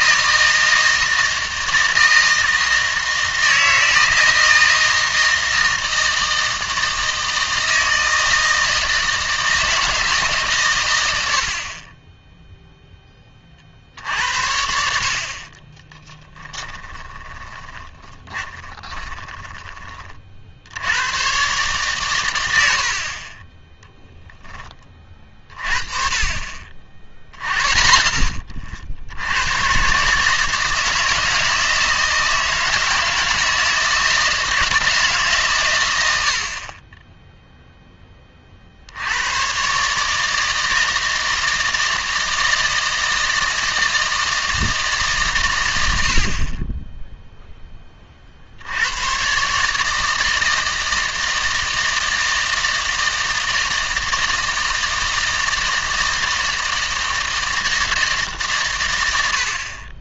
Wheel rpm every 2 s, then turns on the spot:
160, 160, 160, 160, 160, 120, 0, 70, 20, 20, 70, 80, 20, 50, 60, 160, 160, 160, 30, 50, 160, 160, 160, 30, 80, 160, 160, 160, 160, 130.
16-20